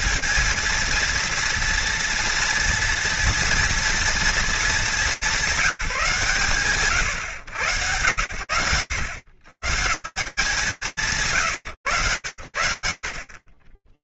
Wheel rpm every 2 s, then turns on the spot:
230, 230, 200, 110, 100, 190, 90.
none